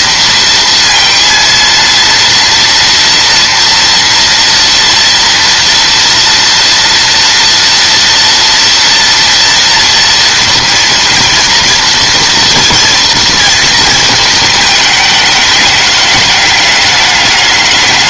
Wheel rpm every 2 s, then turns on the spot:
230, 230, 230, 230, 230, 230, 230, 220, 210.
none